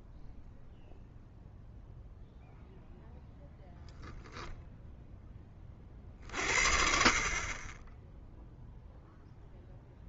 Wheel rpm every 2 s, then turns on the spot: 0, 0, 0, 50, 0.
none